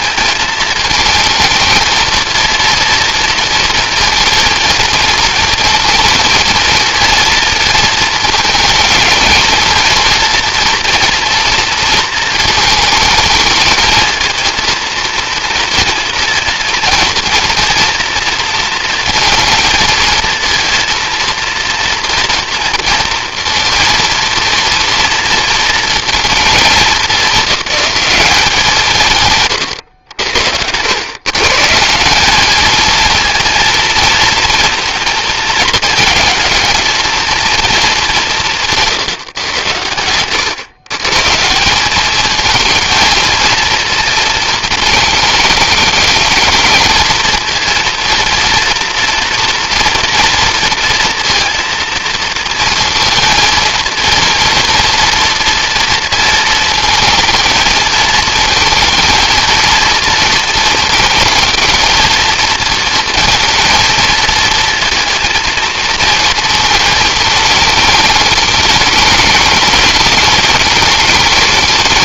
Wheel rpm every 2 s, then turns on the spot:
220, 230, 230, 230, 220, 240, 230, 220, 230, 230, 230, 230, 230, 210, 170, 90, 220, 230, 220, 170, 120, 220, 220, 220, 230, 230, 230, 230, 220, 220, 230, 230, 230, 220, 220, 210.
none